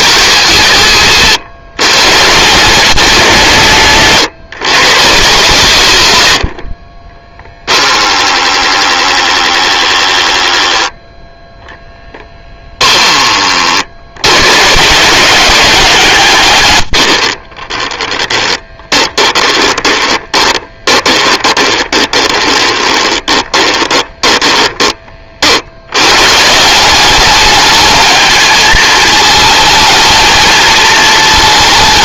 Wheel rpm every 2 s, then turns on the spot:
120, 160, 120, 40, 10, 10, 10, 120, 120, 10, 20, 20, 20, 170, 220, 220.
6-8 18-26